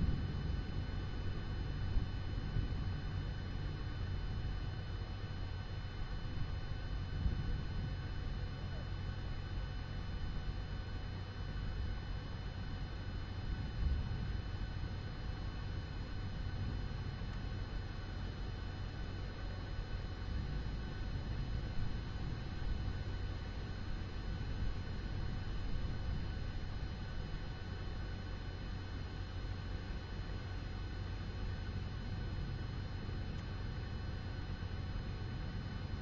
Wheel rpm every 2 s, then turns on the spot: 0, 0, 0, 0, 0, 0, 0, 0, 0, 0, 0, 0, 0, 0, 0, 0, 0, 0.
none